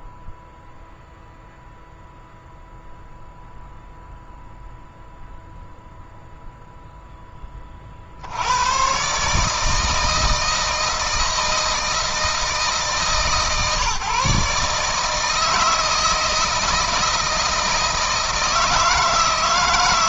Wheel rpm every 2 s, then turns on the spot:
0, 0, 0, 0, 110, 160, 160, 150, 160, 160.
none